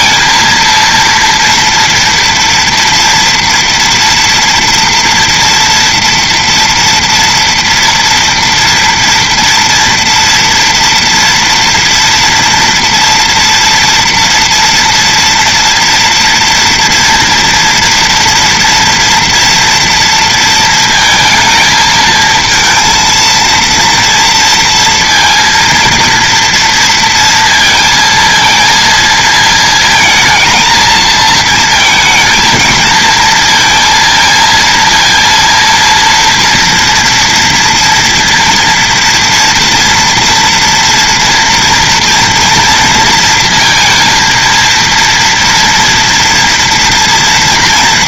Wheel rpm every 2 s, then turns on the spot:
230, 230, 230, 230, 230, 240, 230, 230, 230, 230, 230, 220, 230, 230, 230, 230, 220, 230, 230, 230, 230, 230, 230, 230.
none